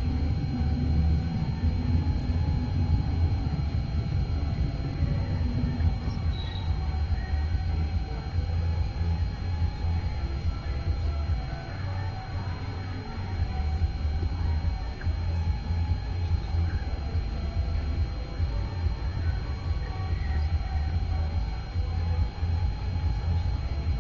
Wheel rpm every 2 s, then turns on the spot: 0, 0, 0, 0, 0, 0, 0, 0, 0, 0, 0, 0.
none